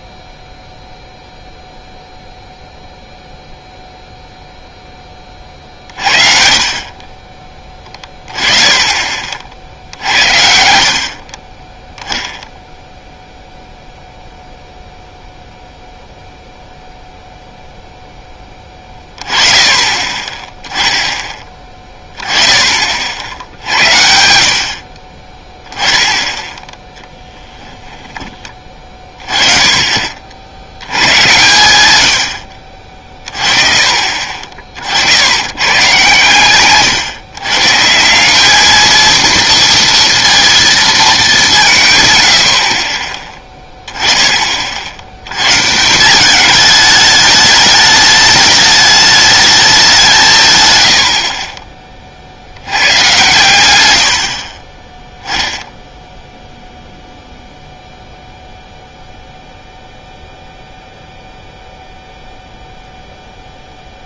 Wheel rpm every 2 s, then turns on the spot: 0, 0, 0, 40, 20, 60, 0, 0, 0, 10, 10, 20, 60, 10, 20, 80, 60, 50, 130, 210, 230, 60, 30, 210, 210, 130, 80, 40, 0, 0, 0, 0.
none